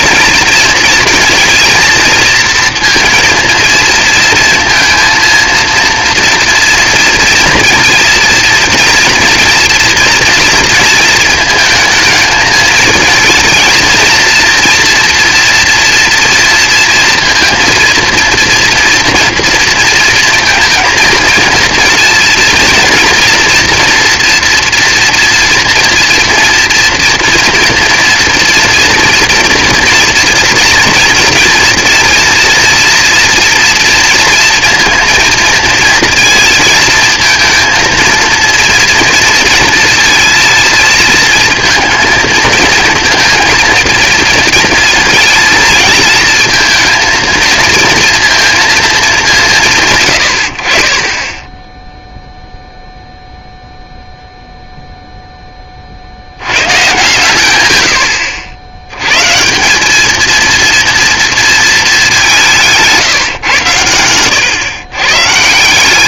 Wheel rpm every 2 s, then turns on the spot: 230, 230, 230, 230, 240, 230, 220, 230, 230, 230, 230, 230, 240, 230, 230, 230, 240, 230, 230, 230, 230, 220, 230, 220, 220, 50, 0, 0, 120, 90, 230, 170, 120.
none